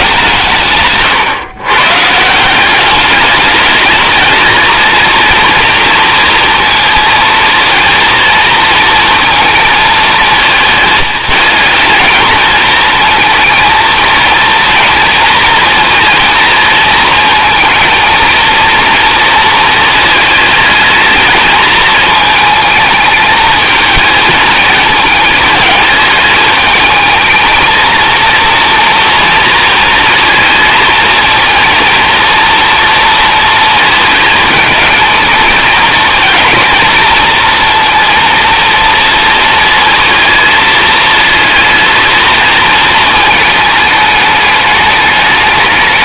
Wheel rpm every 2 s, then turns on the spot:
140, 190, 220, 230, 230, 220, 230, 230, 230, 230, 220, 220, 220, 220, 230, 230, 230, 220, 230, 230, 220, 220, 210.
none